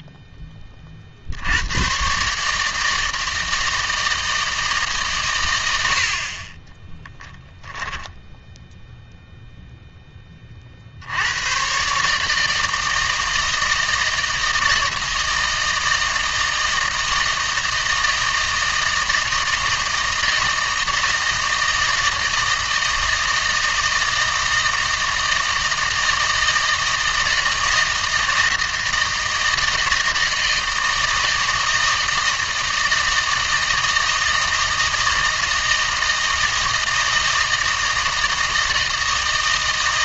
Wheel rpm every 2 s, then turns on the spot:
20, 160, 150, 20, 0, 50, 160, 160, 160, 160, 160, 160, 160, 160, 160, 160, 160, 160, 160, 160.
6-8